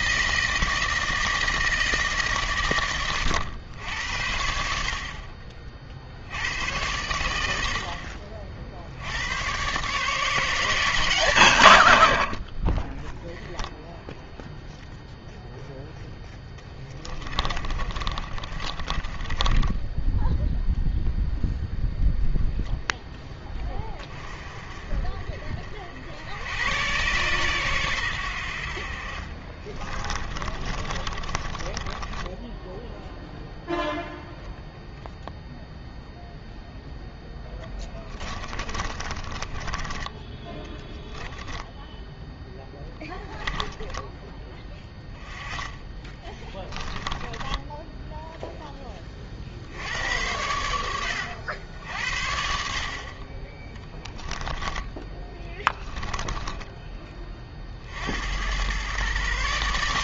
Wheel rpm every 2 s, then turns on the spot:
160, 120, 60, 90, 60, 160, 20, 0, 10, 30, 0, 0, 40, 90, 70, 30, 10, 0, 0, 30, 10, 0, 10, 10, 10, 100, 60, 10, 10, 110.
16-20 30-34 38-40 46-48 54-58